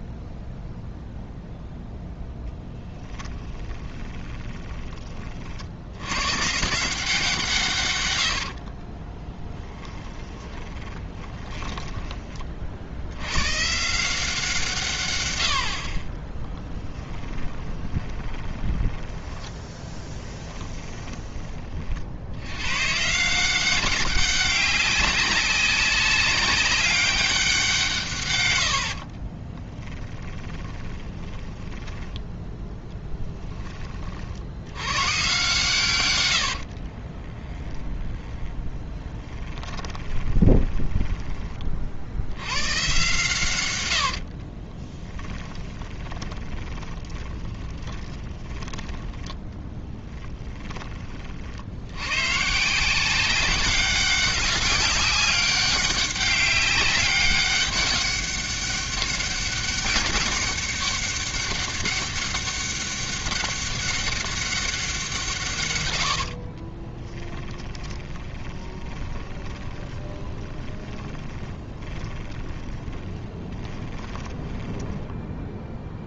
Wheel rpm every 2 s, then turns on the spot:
0, 10, 20, 150, 50, 20, 60, 150, 10, 10, 10, 120, 200, 190, 80, 20, 10, 100, 60, 20, 10, 120, 30, 20, 20, 20, 160, 200, 200, 200, 200, 200, 190, 30, 20, 20, 10, 10.
2-4 8-12 16-22 30-32 36-42 44-50 66-76